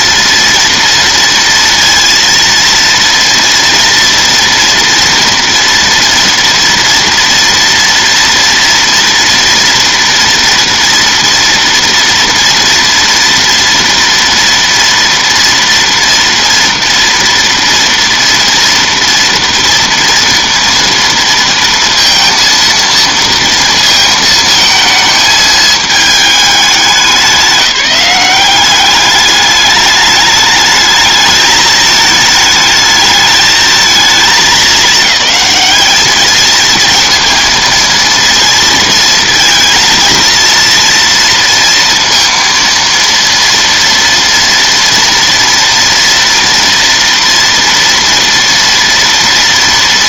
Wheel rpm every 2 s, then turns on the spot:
230, 230, 240, 230, 230, 240, 230, 230, 230, 230, 230, 230, 220, 200, 200, 210, 220, 210, 230, 230, 230, 230, 230, 230, 230.
none